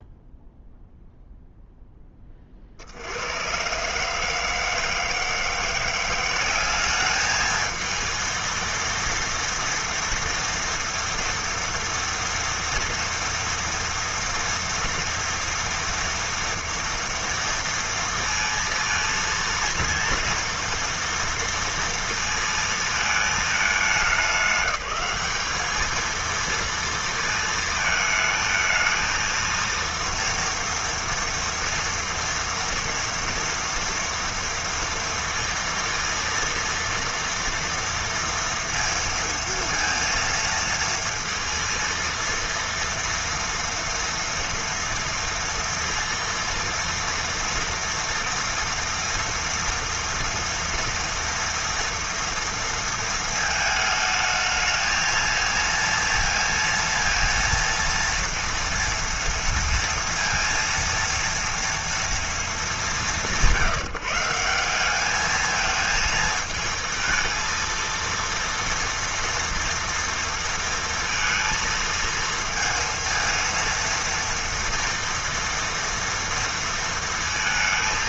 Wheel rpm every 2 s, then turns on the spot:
0, 60, 160, 200, 230, 230, 230, 230, 230, 230, 230, 230, 200, 230, 220, 230, 230, 230, 230, 230, 230, 230, 230, 230, 230, 230, 230, 220, 230, 230, 230, 210, 190, 220, 230, 230, 230, 230, 230.
none